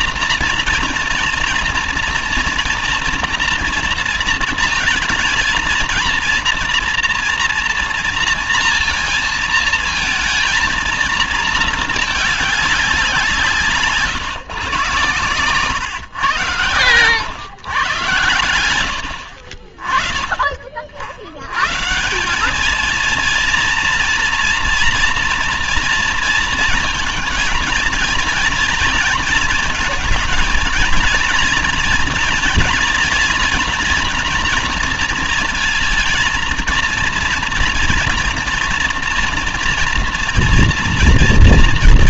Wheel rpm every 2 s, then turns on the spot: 230, 230, 230, 230, 230, 230, 200, 130, 110, 100, 50, 210, 240, 230, 230, 220, 230, 230, 230, 230, 230.
none